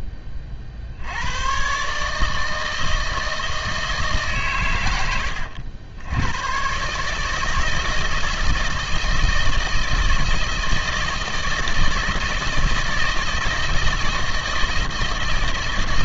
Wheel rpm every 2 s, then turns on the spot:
50, 160, 130, 120, 160, 160, 160, 170.
none